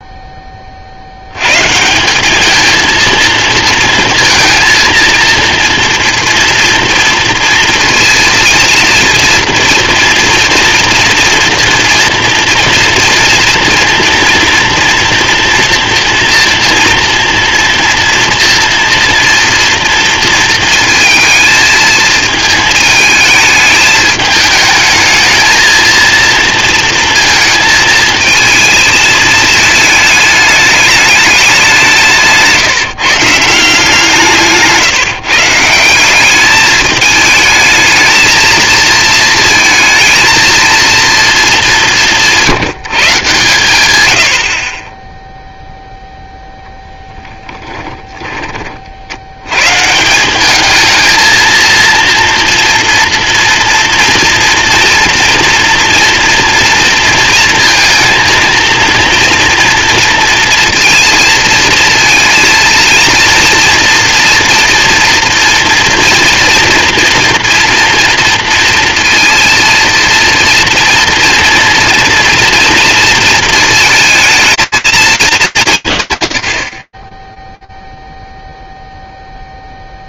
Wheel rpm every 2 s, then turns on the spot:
30, 220, 230, 230, 230, 230, 230, 230, 230, 240, 230, 220, 210, 230, 220, 210, 150, 160, 210, 220, 230, 160, 30, 0, 30, 200, 230, 230, 230, 230, 230, 230, 230, 230, 230, 230, 230, 220, 50, 0.
none